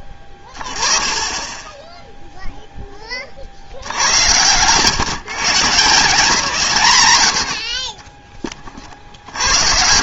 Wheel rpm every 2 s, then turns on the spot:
20, 10, 140, 100, 30.
none